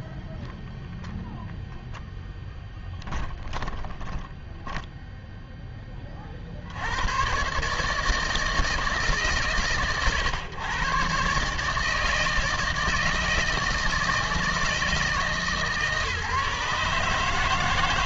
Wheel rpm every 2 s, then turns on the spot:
0, 10, 10, 70, 160, 120, 160, 160, 150.
4-6